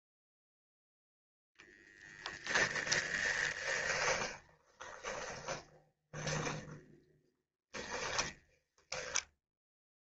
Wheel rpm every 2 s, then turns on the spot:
0, 10, 20, 20, 0.
2-8